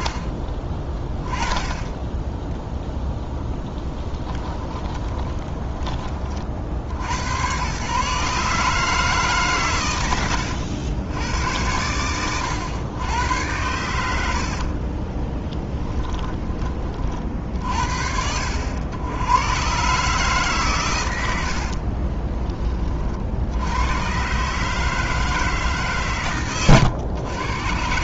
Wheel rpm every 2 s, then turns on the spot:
30, 0, 10, 50, 150, 90, 100, 50, 30, 80, 130, 30, 160, 120.
4-6 14-16